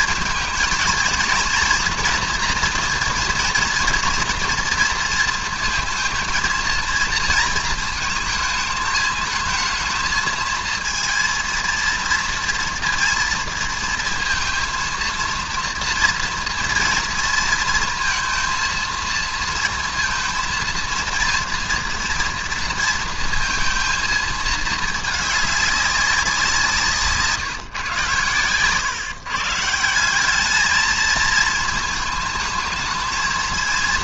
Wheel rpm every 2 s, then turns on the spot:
230, 240, 230, 230, 220, 220, 230, 230, 230, 230, 230, 230, 220, 160, 130, 220, 220.
none